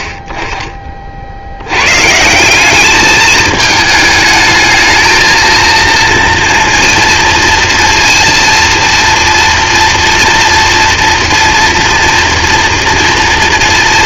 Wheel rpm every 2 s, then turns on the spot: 20, 180, 220, 230, 230, 230, 230.
none